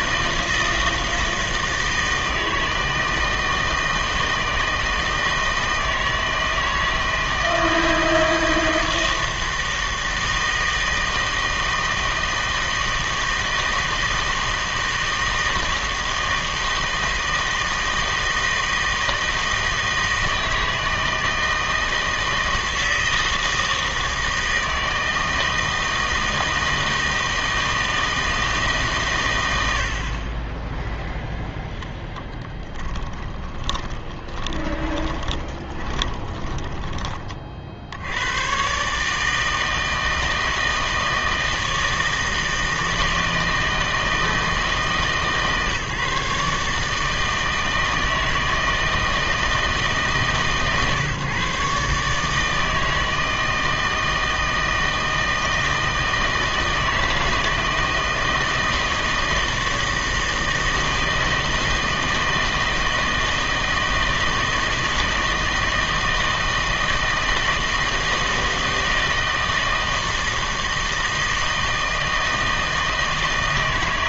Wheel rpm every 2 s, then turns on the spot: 160, 160, 160, 160, 160, 160, 160, 160, 160, 160, 160, 160, 160, 160, 150, 10, 20, 20, 10, 130, 160, 160, 160, 150, 160, 130, 160, 160, 160, 160, 160, 160, 160, 160, 160, 160, 160.
34-36